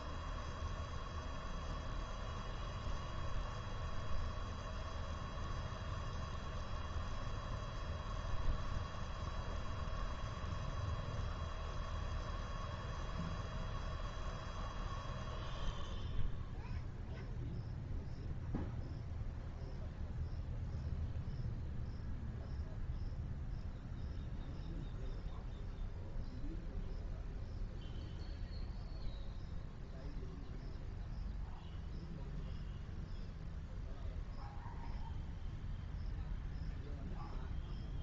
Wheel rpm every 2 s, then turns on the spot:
0, 0, 0, 0, 0, 0, 0, 0, 0, 0, 0, 0, 0, 0, 0, 0, 0, 0, 0.
none